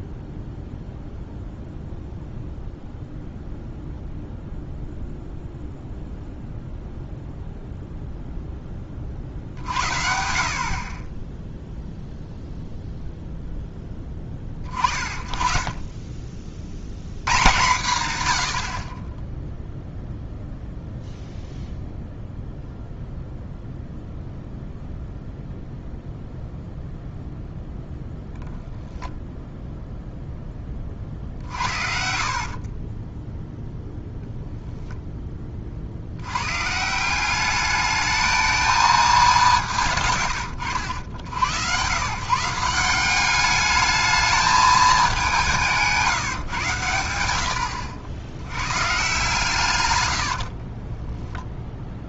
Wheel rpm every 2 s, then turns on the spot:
0, 0, 0, 0, 10, 50, 0, 30, 50, 30, 0, 0, 0, 0, 0, 10, 30, 0, 140, 220, 80, 170, 210, 110, 120, 40.
32-34 50-52